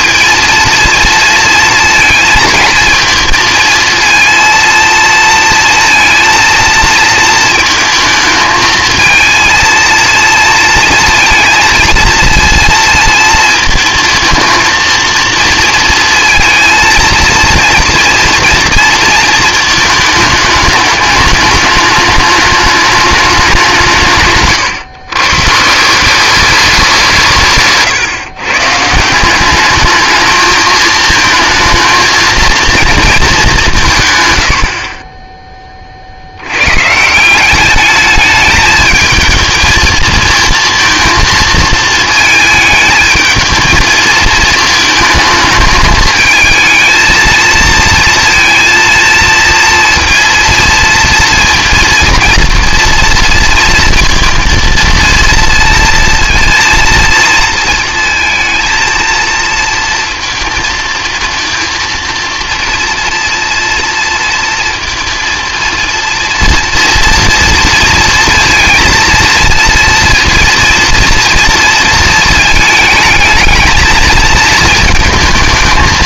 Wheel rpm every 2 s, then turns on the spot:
230, 230, 230, 230, 220, 230, 230, 220, 230, 230, 210, 210, 140, 200, 140, 220, 230, 70, 110, 220, 220, 220, 220, 220, 230, 230, 230, 230, 230, 230, 220, 230, 230, 230, 230, 230, 220, 220.
24-26